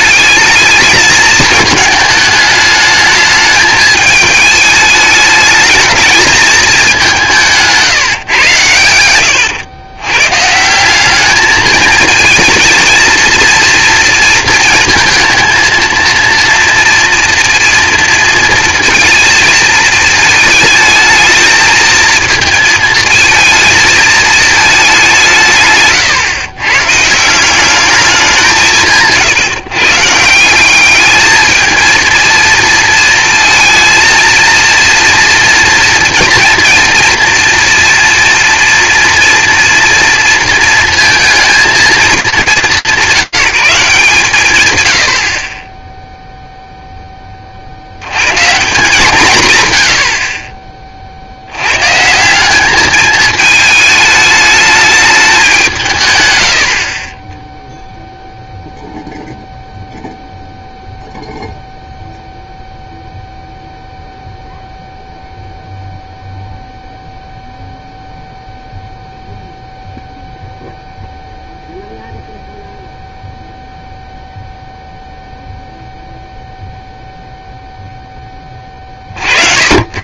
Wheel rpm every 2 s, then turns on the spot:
210, 210, 220, 210, 120, 140, 220, 230, 230, 230, 220, 220, 220, 120, 180, 170, 230, 230, 230, 230, 230, 200, 120, 0, 160, 40, 210, 210, 70, 0, 0, 0, 0, 0, 0, 0, 0, 0, 0, 50.
none